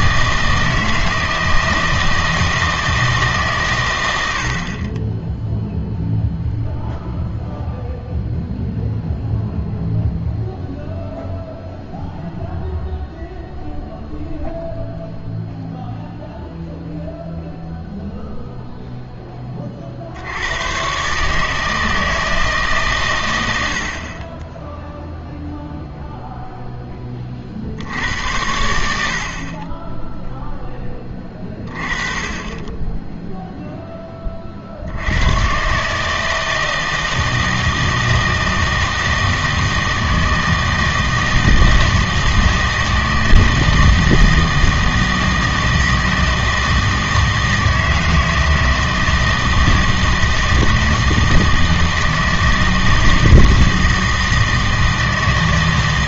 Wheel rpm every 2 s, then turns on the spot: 160, 160, 50, 0, 0, 0, 0, 0, 0, 0, 110, 150, 10, 10, 80, 10, 10, 50, 160, 160, 160, 160, 160, 160, 160, 160, 160, 160.
none